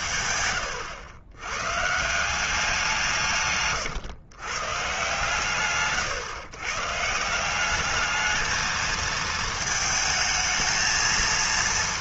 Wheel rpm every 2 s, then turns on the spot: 120, 170, 130, 140, 220, 220.
none